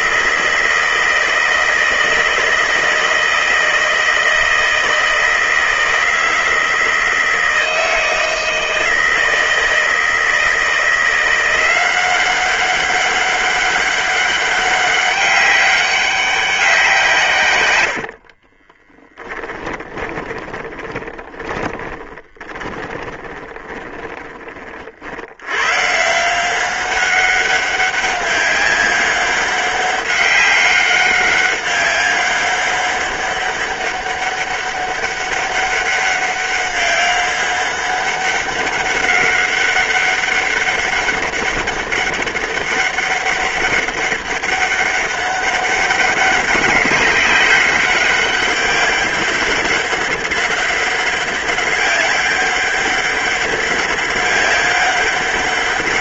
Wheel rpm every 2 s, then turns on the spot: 160, 160, 160, 160, 160, 170, 190, 200, 150, 10, 30, 20, 80, 190, 200, 200, 200, 200, 200, 200, 200, 200, 200, 190, 200, 200, 200, 200.
18-24